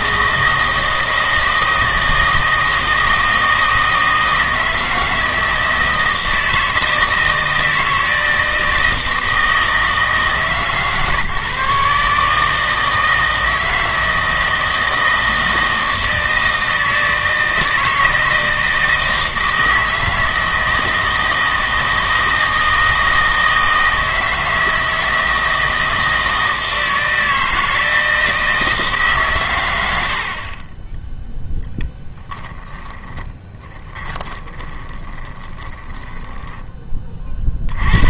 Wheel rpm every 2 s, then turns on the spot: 160, 160, 160, 160, 160, 140, 160, 160, 160, 160, 160, 160, 160, 160, 150, 20, 20, 20, 20.
32-36